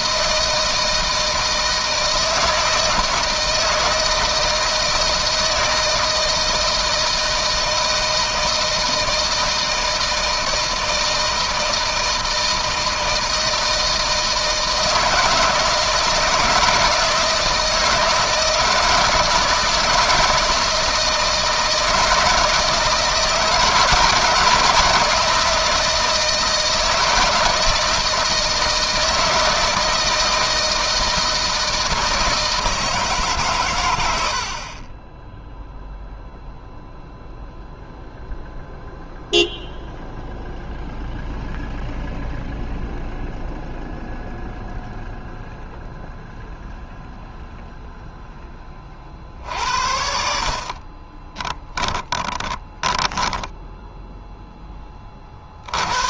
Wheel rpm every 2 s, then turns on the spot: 160, 160, 160, 160, 160, 160, 160, 160, 160, 160, 160, 160, 160, 160, 160, 160, 140, 10, 0, 0, 0, 0, 0, 0, 40, 30, 10, 30.
50-54